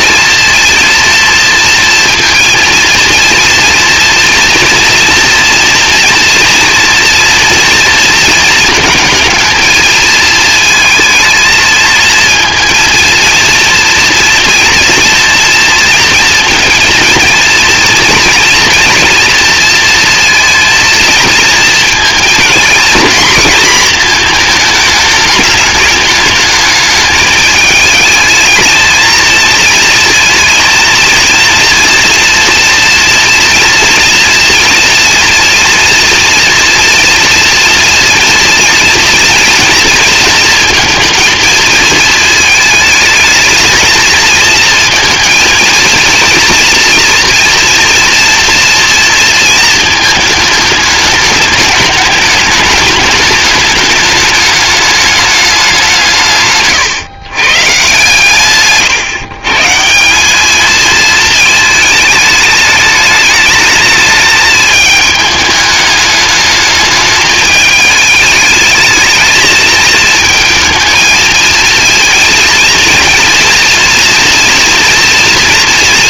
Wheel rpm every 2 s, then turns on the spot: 230, 230, 230, 230, 220, 220, 230, 230, 230, 230, 230, 230, 210, 220, 230, 230, 230, 230, 230, 230, 230, 220, 230, 240, 230, 210, 210, 210, 140, 130, 220, 210, 220, 210, 220, 230, 230, 240.
none